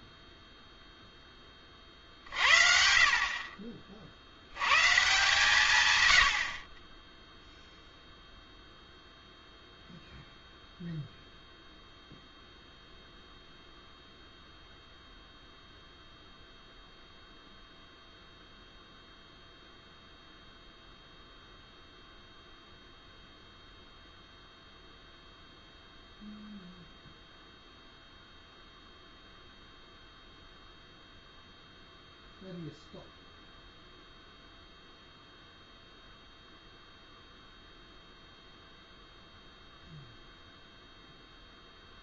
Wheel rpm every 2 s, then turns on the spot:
0, 50, 60, 90, 0, 0, 0, 0, 0, 0, 0, 0, 0, 0, 0, 0, 0, 0, 0, 0, 0.
none